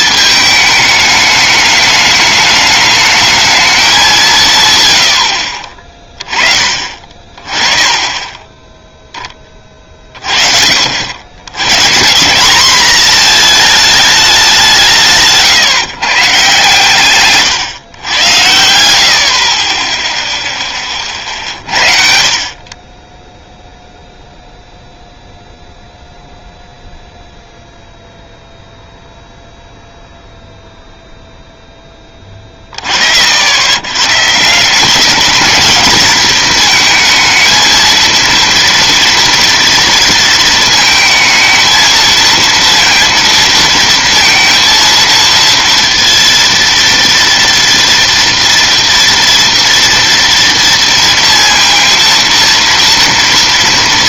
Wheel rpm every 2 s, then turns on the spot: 210, 210, 130, 30, 10, 80, 230, 160, 140, 60, 30, 20, 0, 0, 0, 0, 80, 210, 220, 240, 220, 230, 230, 230, 230, 230, 230.
none